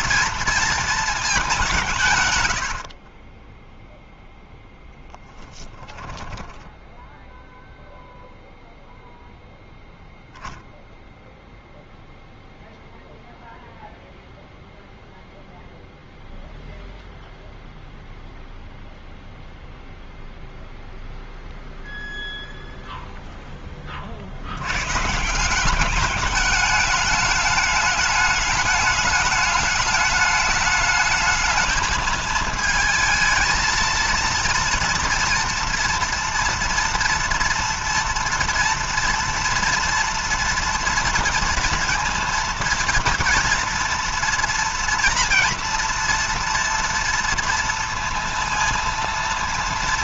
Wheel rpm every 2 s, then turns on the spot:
220, 30, 10, 0, 0, 0, 0, 0, 0, 0, 0, 0, 150, 210, 210, 210, 220, 230, 230, 230, 230, 230, 230, 230, 230.
4-6